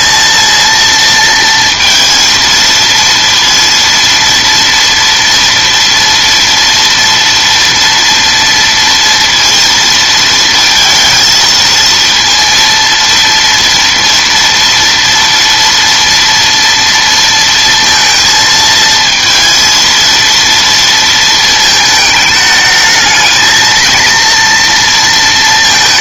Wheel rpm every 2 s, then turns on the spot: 230, 230, 230, 230, 230, 230, 230, 230, 230, 220, 230, 220, 230.
none